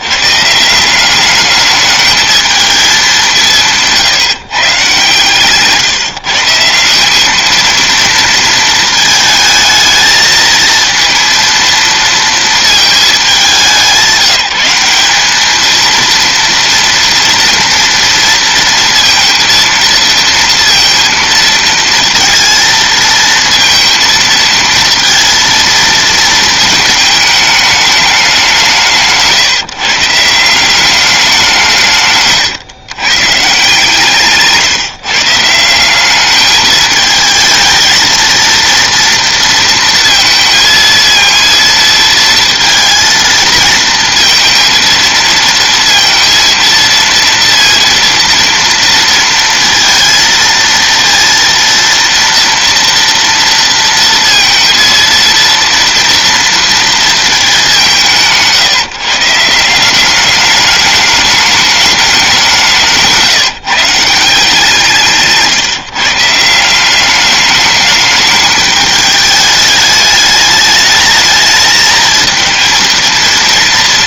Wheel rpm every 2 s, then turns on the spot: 160, 220, 140, 170, 230, 230, 220, 180, 230, 230, 230, 220, 230, 220, 190, 190, 130, 150, 210, 230, 230, 230, 230, 230, 230, 230, 230, 230, 230, 160, 210, 180, 170, 170, 220, 210, 220.
none